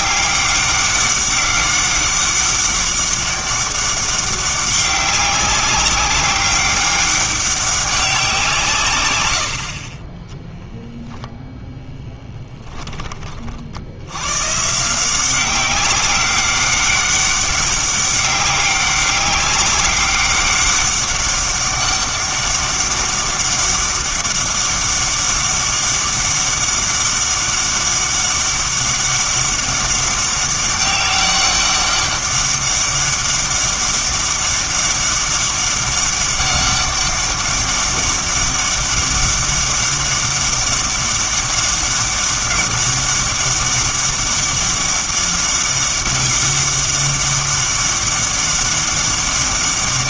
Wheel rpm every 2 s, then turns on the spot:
200, 200, 200, 200, 160, 0, 10, 150, 200, 190, 200, 200, 200, 200, 200, 190, 200, 200, 200, 200, 200, 200, 200, 200, 200.
none